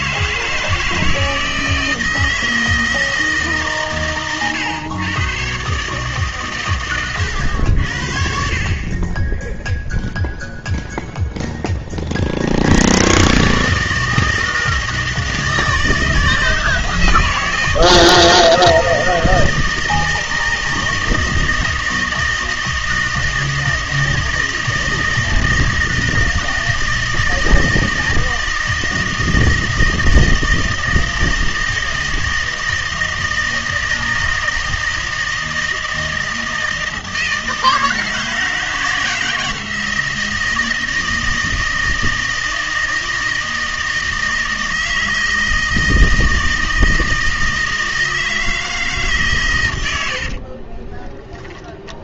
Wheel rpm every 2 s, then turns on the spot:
160, 160, 120, 120, 40, 0, 80, 160, 160, 160, 160, 160, 160, 160, 160, 160, 160, 160, 160, 160, 160, 160, 160, 160, 160, 20.
50-52